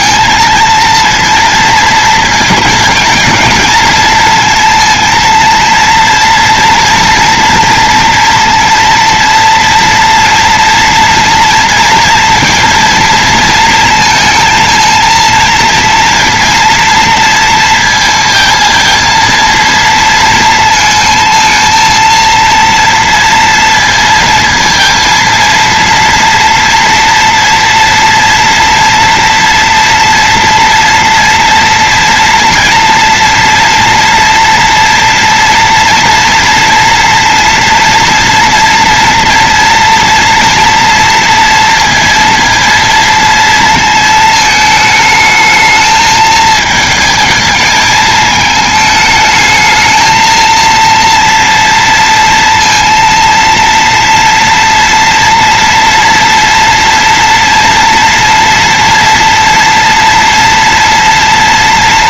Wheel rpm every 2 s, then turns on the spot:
220, 220, 230, 230, 230, 230, 230, 230, 230, 230, 220, 230, 230, 230, 240, 240, 230, 230, 230, 230, 230, 230, 220, 220, 220, 230, 230, 230, 230, 240, 230.
none